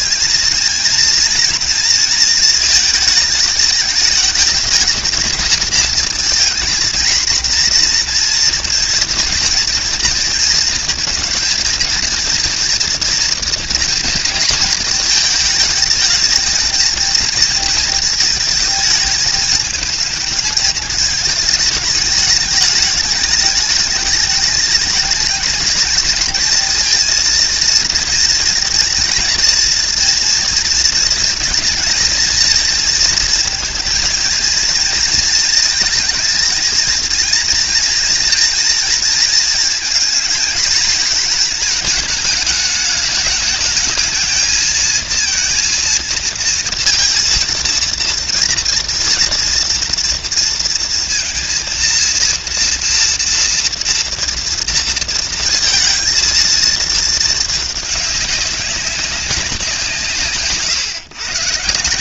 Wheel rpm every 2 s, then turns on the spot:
220, 220, 220, 230, 240, 230, 230, 220, 230, 220, 220, 210, 210, 230, 230, 230, 220, 230, 230, 230, 230, 210, 230, 230, 230, 230, 230, 230, 230, 200, 150.
none